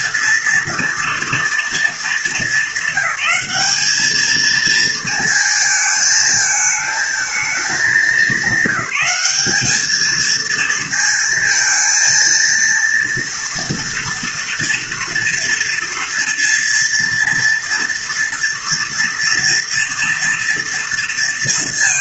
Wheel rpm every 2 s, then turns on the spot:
230, 200, 220, 220, 190, 220, 230, 230, 230, 230, 230.
none